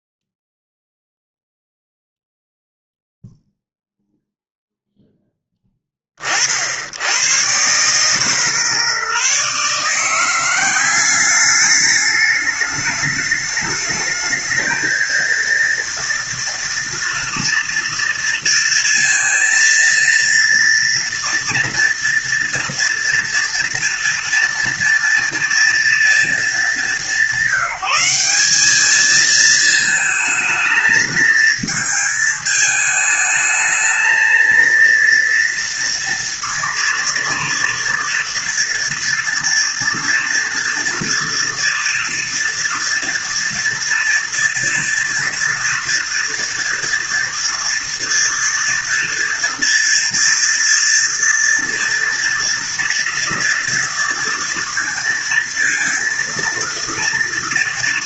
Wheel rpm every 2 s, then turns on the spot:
0, 0, 0, 80, 140, 200, 210, 230, 230, 230, 230, 230, 230, 200, 210, 230, 220, 230, 230, 230, 230, 230, 230, 230, 230, 240, 230, 230, 240.
none